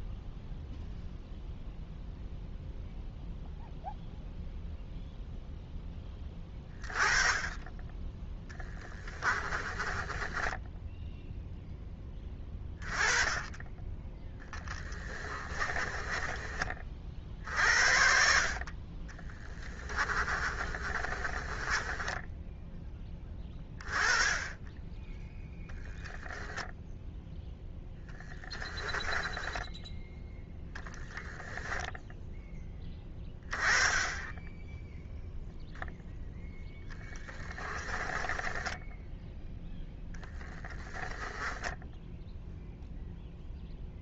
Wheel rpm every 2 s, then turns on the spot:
0, 0, 0, 30, 10, 10, 20, 20, 30, 40, 30, 10, 10, 0, 10, 0, 10, 10, 10, 10, 20, 0.
8-12 14-16 20-22 28-30 38-42